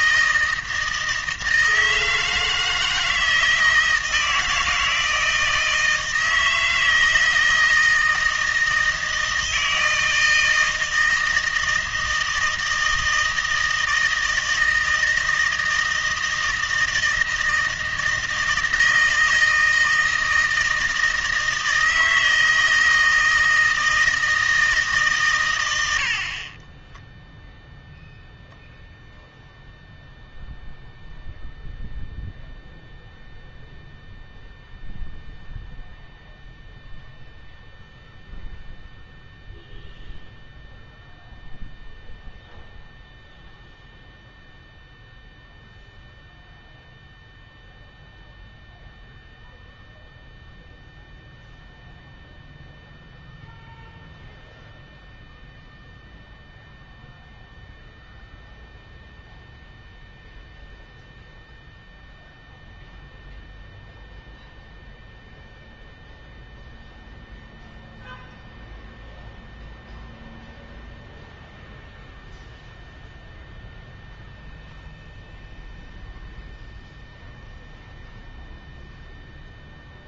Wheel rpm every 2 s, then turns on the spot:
160, 160, 160, 160, 160, 160, 160, 160, 160, 160, 160, 160, 160, 20, 0, 0, 0, 0, 0, 0, 0, 0, 0, 0, 0, 0, 0, 0, 0, 0, 0, 0, 0, 0, 0, 0, 0, 0, 0, 0.
26-28